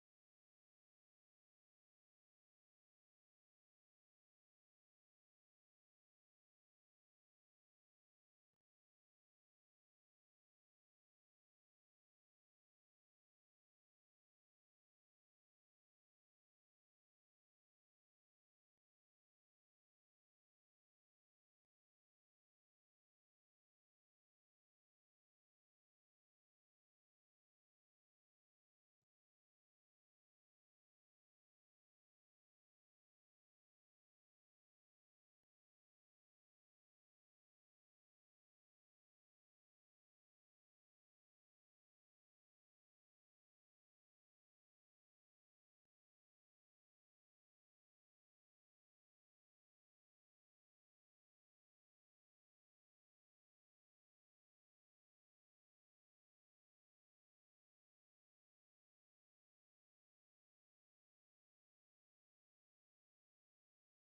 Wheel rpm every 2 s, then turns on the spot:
0, 0, 0, 0, 0, 0, 0, 0, 0, 0, 0, 0, 0, 0, 0, 0, 0, 0, 0, 0, 0, 0, 0, 0, 0, 0, 0, 0, 0, 0, 0, 0.
none